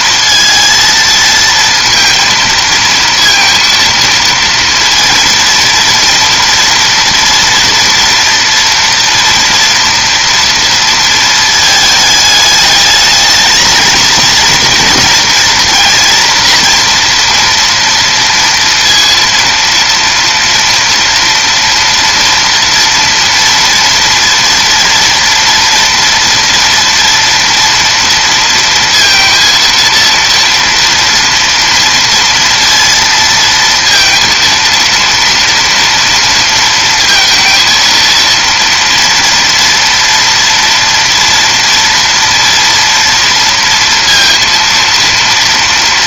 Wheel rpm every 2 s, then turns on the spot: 230, 230, 230, 230, 230, 230, 210, 230, 230, 230, 230, 230, 230, 230, 230, 230, 230, 230, 230, 230, 230, 240, 230.
none